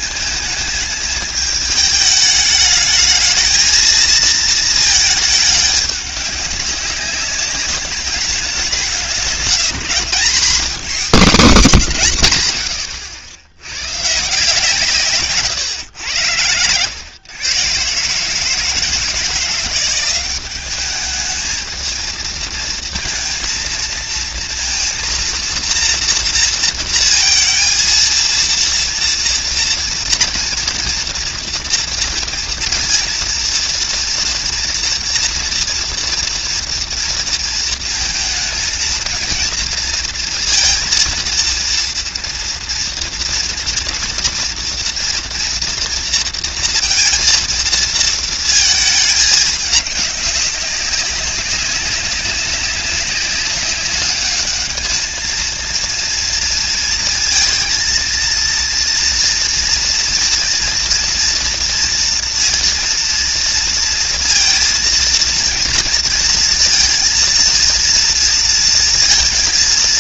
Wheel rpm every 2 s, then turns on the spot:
220, 210, 220, 200, 200, 170, 140, 130, 100, 130, 180, 220, 230, 230, 230, 230, 230, 230, 230, 230, 230, 230, 230, 230, 230, 200, 190, 200, 230, 230, 230, 230, 230, 230, 230.
none